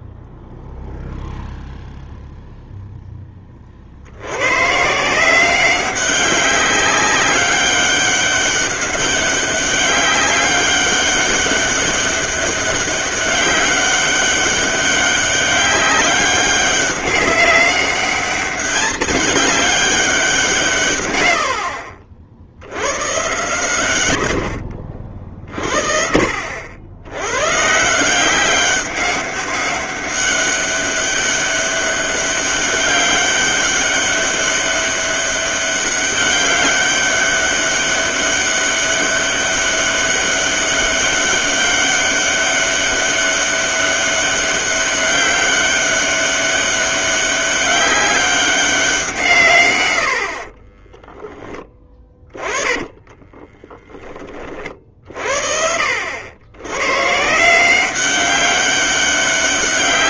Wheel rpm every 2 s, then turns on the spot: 0, 0, 130, 190, 200, 200, 200, 200, 200, 210, 140, 90, 60, 80, 190, 200, 200, 200, 200, 200, 200, 200, 200, 190, 190, 20, 20, 50, 130, 200.
24-26 50-54